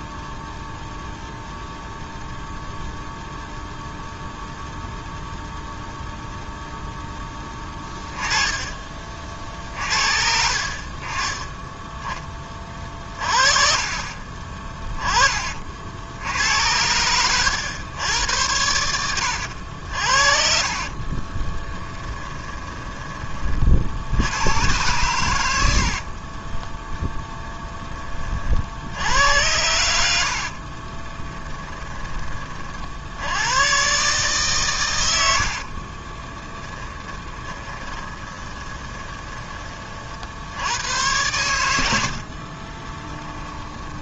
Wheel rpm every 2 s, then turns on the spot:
0, 0, 0, 0, 40, 30, 30, 20, 90, 80, 40, 20, 110, 10, 70, 40, 60, 100, 20, 20, 90, 20.
20-24 30-32 36-40 42-44